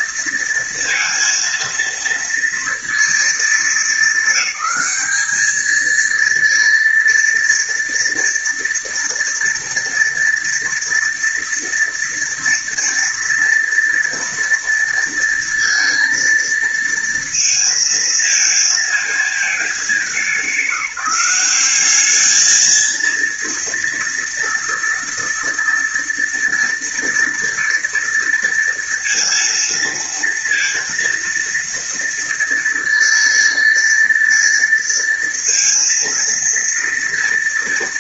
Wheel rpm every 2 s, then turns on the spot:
230, 230, 210, 230, 230, 230, 230, 230, 230, 220, 190, 220, 230, 230, 230, 230, 230, 230, 230.
none